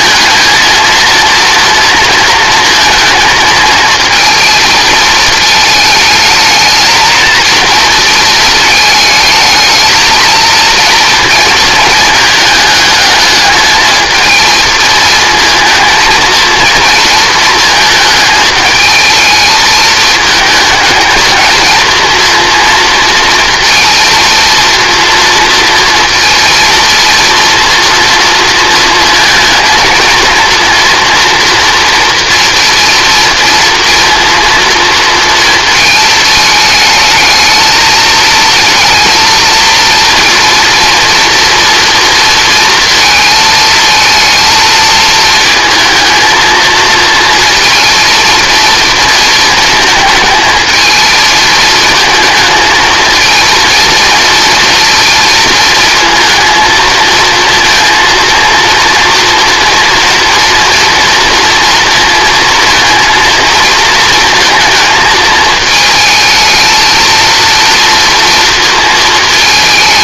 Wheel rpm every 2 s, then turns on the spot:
220, 230, 230, 220, 220, 230, 220, 220, 230, 220, 220, 230, 230, 230, 230, 230, 230, 240, 220, 220, 230, 230, 230, 230, 230, 220, 220, 230, 220, 230, 230, 230, 230, 220, 230.
none